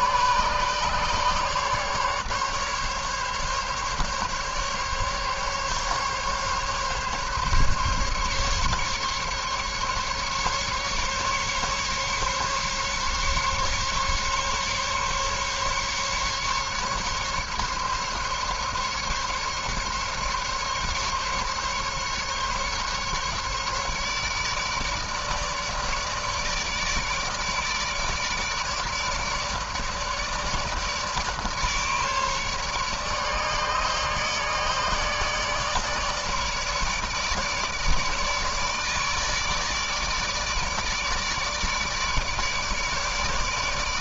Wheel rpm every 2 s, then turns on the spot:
150, 140, 140, 140, 140, 140, 140, 140, 140, 140, 140, 140, 150, 150, 150, 150, 150, 150, 150, 150, 150, 150.
none